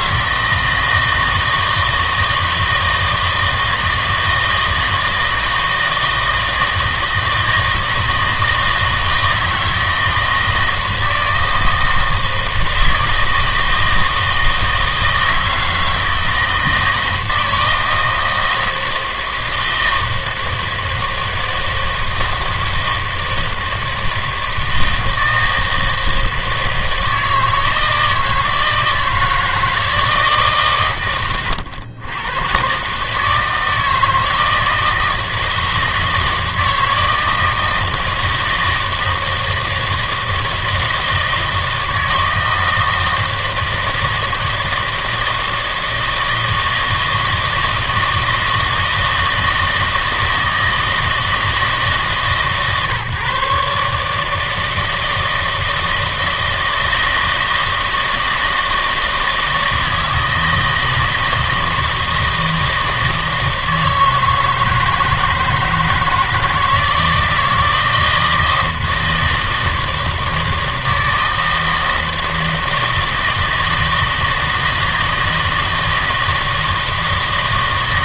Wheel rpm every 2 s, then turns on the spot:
160, 160, 160, 160, 160, 160, 160, 160, 160, 160, 160, 160, 160, 160, 160, 140, 120, 160, 160, 160, 160, 160, 160, 160, 160, 160, 140, 160, 160, 160, 160, 160, 160, 160, 160, 160, 160, 160, 160.
none